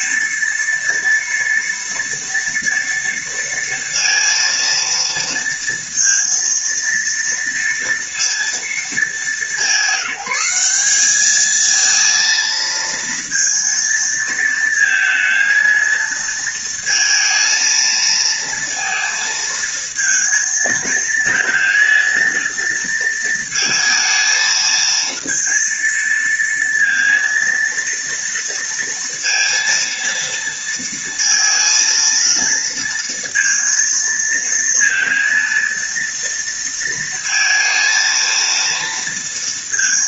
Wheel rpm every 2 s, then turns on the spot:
230, 230, 230, 230, 220, 200, 230, 230, 230, 230, 220, 230, 230, 230, 230, 230, 230, 230, 230, 230.
none